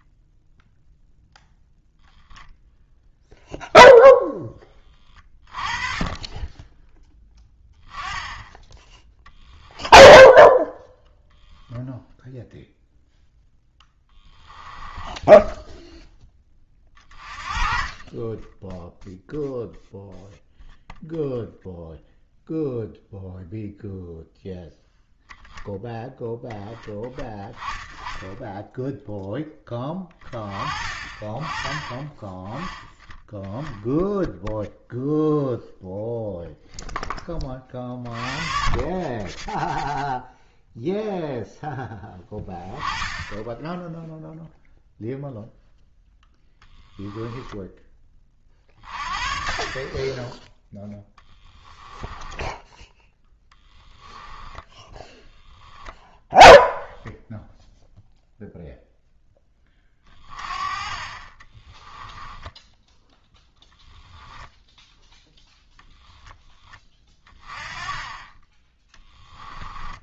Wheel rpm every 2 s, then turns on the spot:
0, 10, 10, 10, 10, 10, 0, 10, 30, 0, 0, 0, 0, 10, 10, 30, 10, 0, 0, 30, 0, 10, 0, 0, 40, 0, 10, 10, 0, 0, 30, 10, 10, 20, 10.
10-12 14-16 62-64